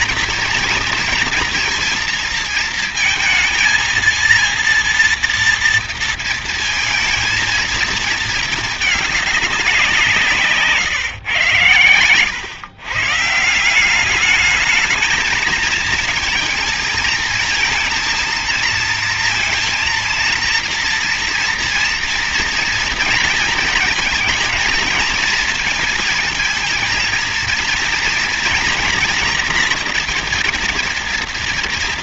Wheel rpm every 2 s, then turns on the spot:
230, 220, 230, 230, 220, 160, 120, 210, 230, 220, 230, 230, 230, 220, 230, 230.
none